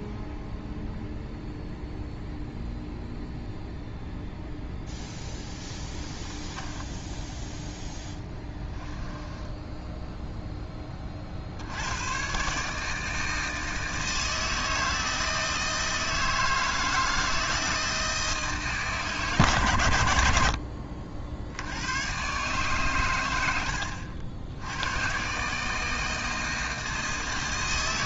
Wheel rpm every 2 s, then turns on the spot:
0, 0, 0, 10, 10, 10, 150, 160, 160, 150, 60, 130, 100, 160.
6-10